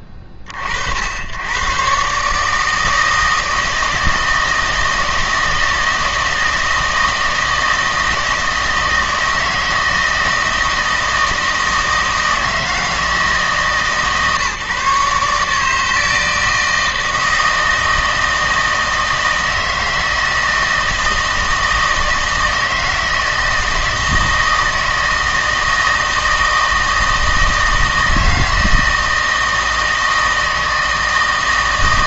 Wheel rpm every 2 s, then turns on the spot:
40, 160, 160, 160, 160, 160, 160, 150, 160, 160, 160, 160, 160, 160, 160, 160.
none